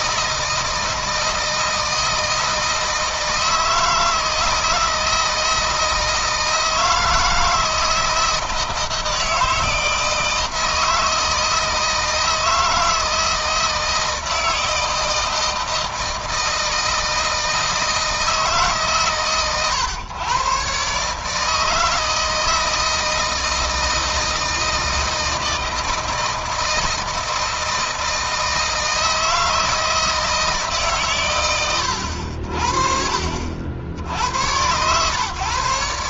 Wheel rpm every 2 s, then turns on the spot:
160, 160, 160, 160, 160, 160, 160, 160, 160, 150, 140, 160, 160, 160, 160, 150, 60, 110.
none